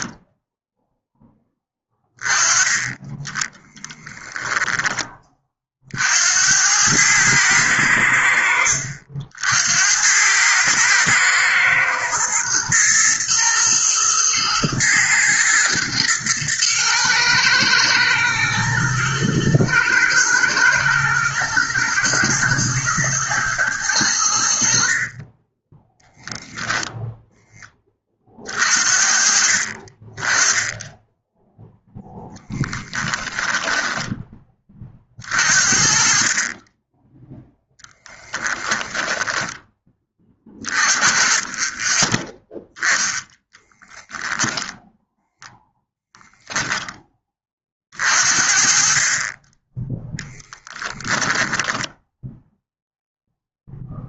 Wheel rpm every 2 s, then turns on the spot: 0, 10, 10, 100, 70, 110, 110, 110, 120, 110, 110, 120, 50, 0, 50, 10, 10, 30, 20, 10, 20, 0, 0, 10, 40, 10, 0.
32-34 50-52